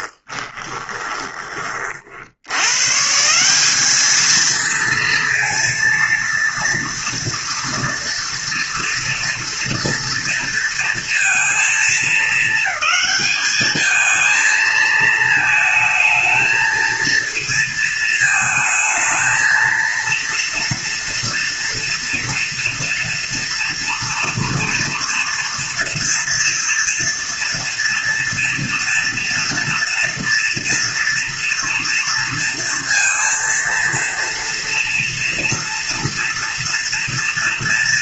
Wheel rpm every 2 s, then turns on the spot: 20, 130, 230, 230, 230, 230, 220, 220, 220, 220, 230, 230, 230, 230, 240, 230, 230, 240, 230.
0-2